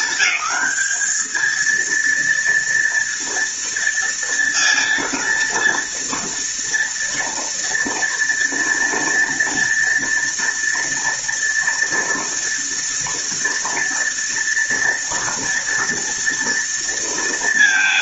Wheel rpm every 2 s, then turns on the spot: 210, 230, 240, 230, 230, 230, 230, 230, 230.
none